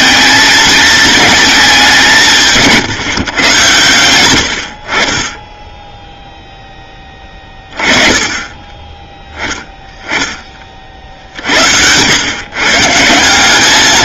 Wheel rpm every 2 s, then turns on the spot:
220, 150, 50, 10, 10, 50, 160.
none